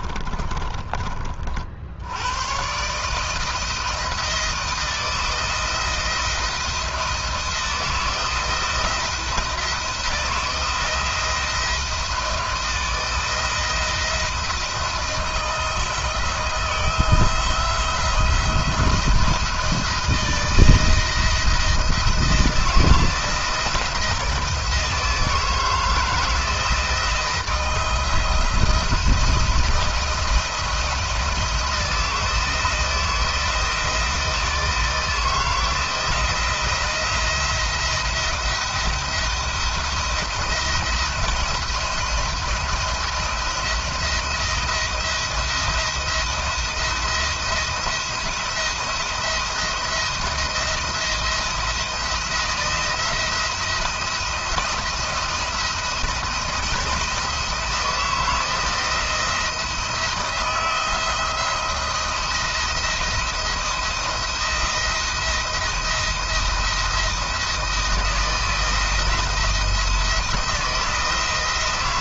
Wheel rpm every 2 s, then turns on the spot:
40, 140, 170, 170, 170, 170, 160, 170, 160, 170, 160, 170, 160, 160, 170, 170, 170, 160, 170, 160, 160, 170, 170, 170, 170, 170, 170, 170, 170, 170, 170, 170, 170, 170, 170, 160.
none